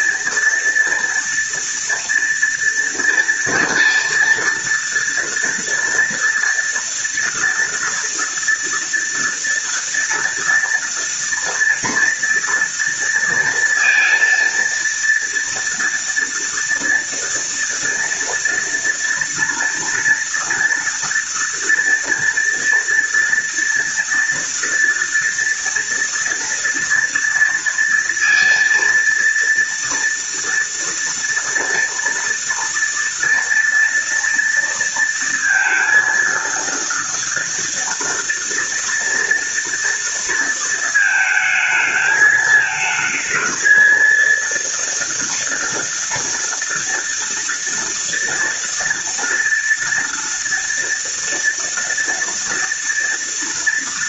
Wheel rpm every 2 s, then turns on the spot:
240, 230, 230, 230, 230, 230, 230, 230, 230, 240, 230, 230, 230, 230, 230, 230, 230, 230, 230, 230, 220, 220, 230, 230, 230, 230, 230.
none